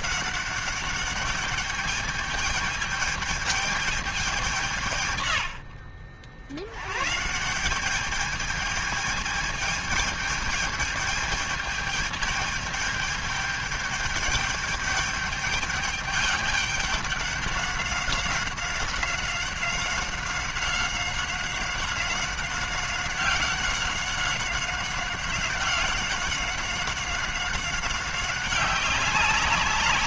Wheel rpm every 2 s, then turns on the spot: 200, 210, 150, 110, 220, 210, 210, 210, 200, 190, 190, 190, 190, 190, 190.
none